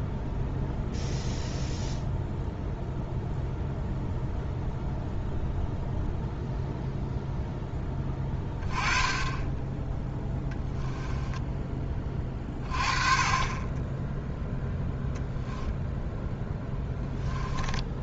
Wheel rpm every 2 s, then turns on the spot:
0, 0, 0, 0, 20, 10, 30, 0, 10.
10-12